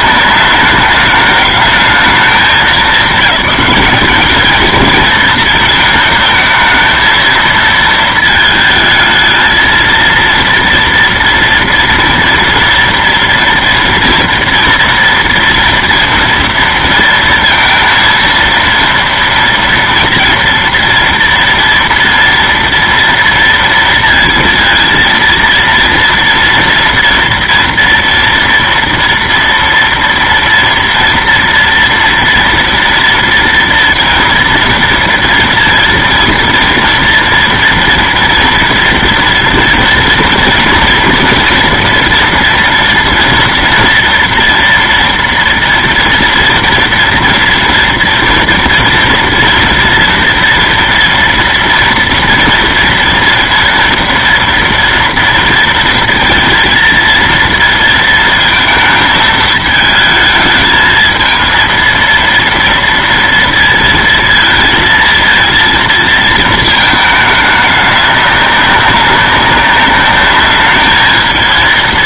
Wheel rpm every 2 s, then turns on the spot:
210, 210, 220, 220, 220, 230, 230, 230, 230, 230, 230, 230, 230, 230, 230, 230, 230, 230, 230, 230, 230, 240, 230, 230, 230, 230, 230, 230, 230, 220, 220, 230, 230, 220, 200, 210.
none